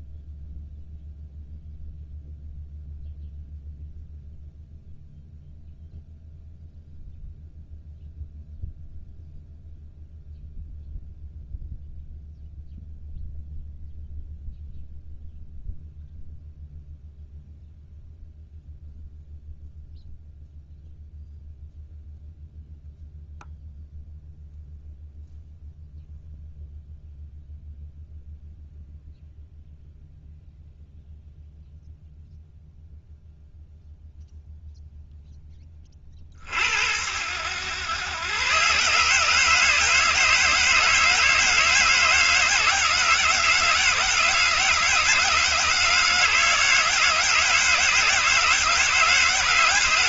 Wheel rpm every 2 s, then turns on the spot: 0, 0, 0, 0, 0, 0, 0, 0, 0, 0, 0, 0, 0, 0, 0, 0, 0, 0, 60, 120, 160, 160, 160, 160, 160.
none